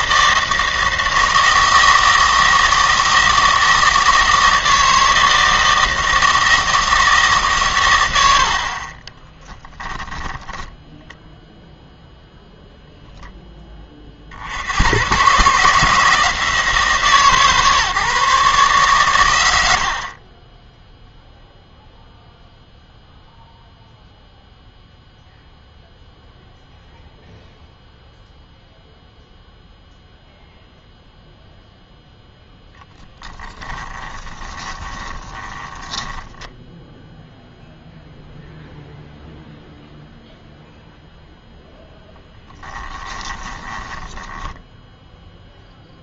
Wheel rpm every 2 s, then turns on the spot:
160, 160, 160, 160, 40, 10, 0, 120, 160, 130, 10, 0, 0, 0, 0, 0, 10, 20, 0, 0, 0, 20, 10.
10-12 20-22 34-36 42-44